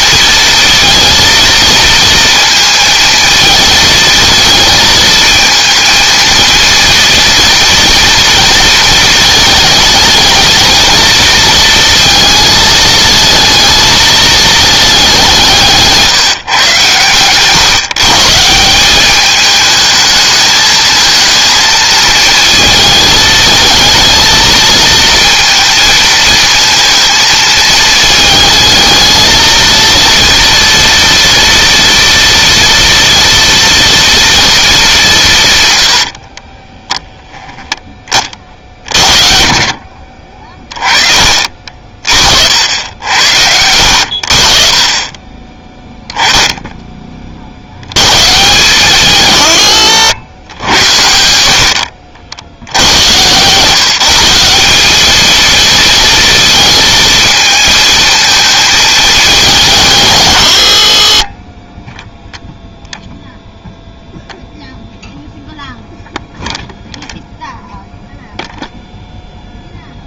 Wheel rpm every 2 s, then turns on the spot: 230, 220, 230, 240, 230, 220, 220, 200, 120, 190, 220, 220, 220, 220, 220, 230, 230, 200, 10, 50, 30, 60, 30, 20, 130, 90, 90, 210, 230, 210, 50, 0, 0, 0, 0.
none